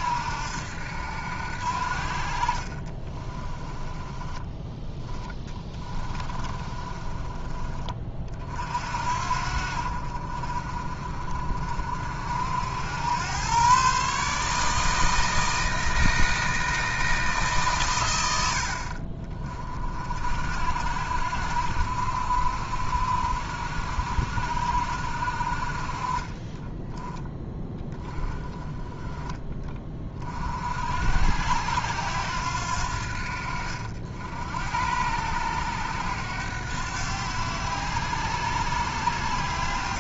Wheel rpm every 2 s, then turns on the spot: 70, 40, 10, 20, 50, 40, 80, 150, 160, 60, 60, 60, 60, 20, 20, 50, 80, 80, 90, 90.
2-4 6-8